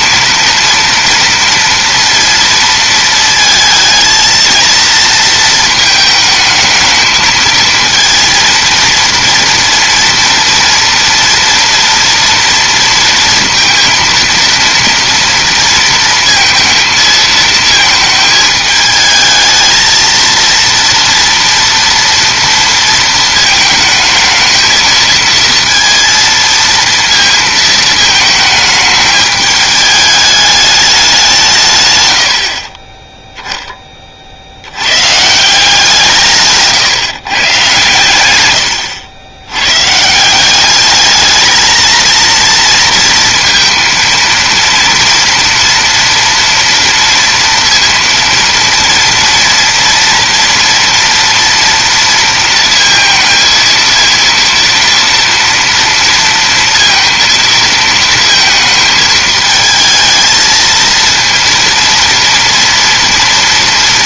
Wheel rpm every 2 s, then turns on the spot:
230, 230, 230, 220, 230, 230, 230, 230, 230, 220, 230, 230, 220, 230, 210, 210, 20, 100, 150, 110, 200, 230, 230, 240, 230, 230, 230, 230, 230, 220, 230, 230.
38-40